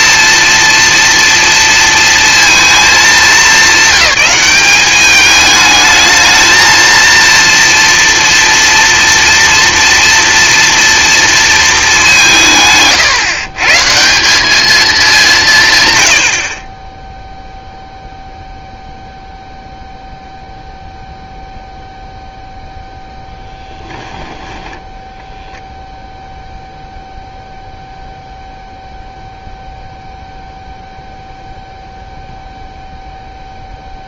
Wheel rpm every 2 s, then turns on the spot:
230, 210, 200, 230, 230, 230, 160, 200, 30, 0, 0, 0, 10, 0, 0, 0, 0.
24-26